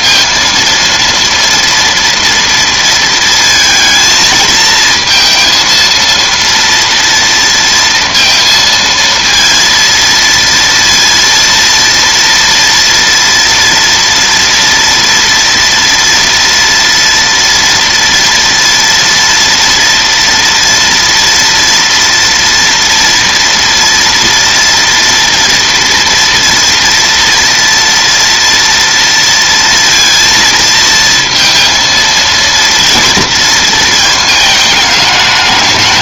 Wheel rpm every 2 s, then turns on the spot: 230, 230, 230, 230, 230, 230, 230, 230, 230, 230, 230, 230, 230, 230, 230, 230, 230, 210.
none